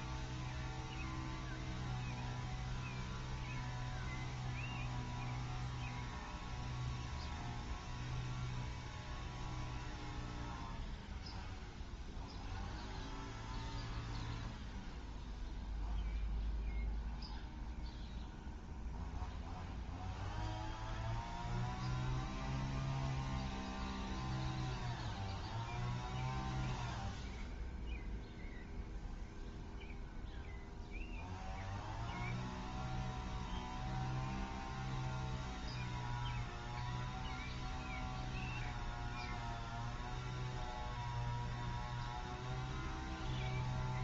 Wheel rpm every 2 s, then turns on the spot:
0, 0, 0, 0, 0, 0, 0, 0, 0, 0, 0, 0, 0, 0, 0, 0, 0, 0, 0, 0, 0, 0.
none